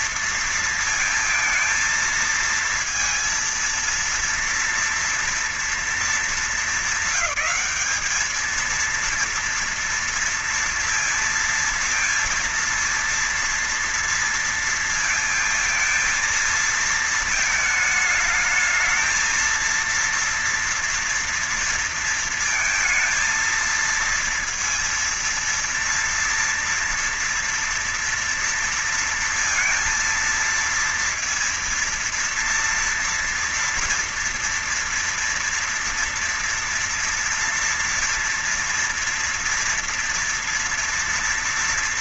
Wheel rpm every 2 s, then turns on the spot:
230, 230, 230, 210, 210, 230, 230, 230, 230, 220, 230, 230, 230, 230, 230, 230, 230, 230, 230, 230, 240.
none